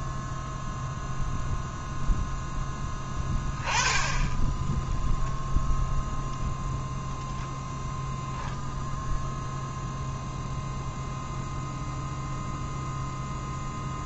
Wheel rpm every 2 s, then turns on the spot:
0, 10, 0, 0, 0, 0, 0.
none